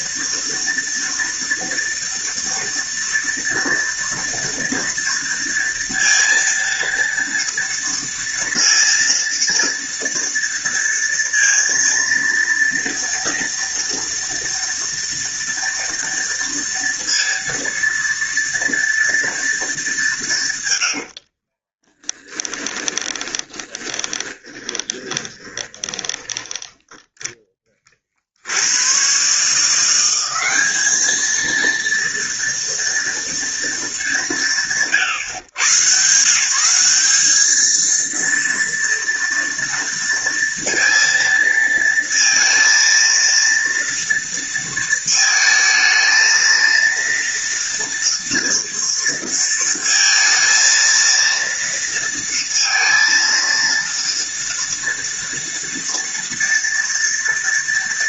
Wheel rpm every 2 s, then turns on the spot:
230, 230, 230, 230, 230, 230, 230, 230, 230, 230, 90, 20, 20, 10, 100, 210, 230, 140, 190, 230, 230, 230, 230, 230, 230, 230, 230, 230, 230.
20-26